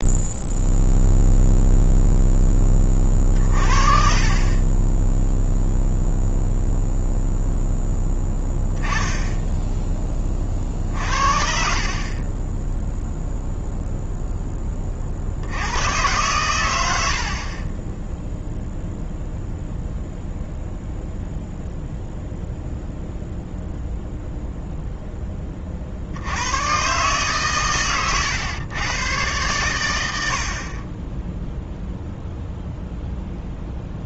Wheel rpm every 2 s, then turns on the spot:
0, 20, 10, 0, 0, 40, 10, 20, 90, 0, 0, 0, 0, 120, 110, 40, 0.
none